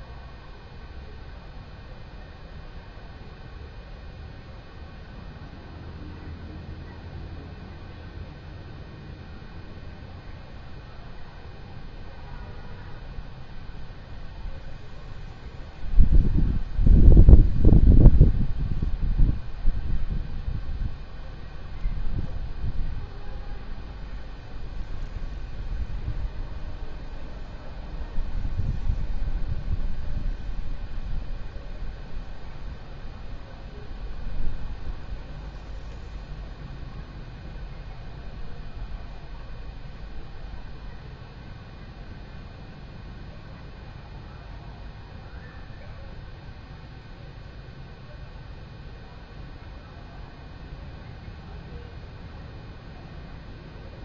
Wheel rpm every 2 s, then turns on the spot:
0, 0, 0, 0, 0, 0, 0, 0, 0, 0, 0, 0, 0, 0, 0, 0, 0, 0, 0, 0, 0, 0, 0, 0, 0, 0, 0.
none